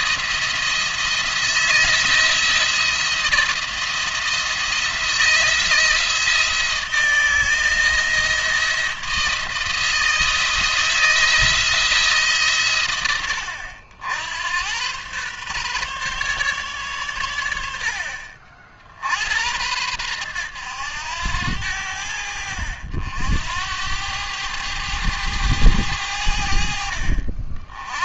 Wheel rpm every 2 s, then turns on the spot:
170, 170, 170, 160, 160, 160, 110, 110, 120, 60, 100, 80, 100, 60.
none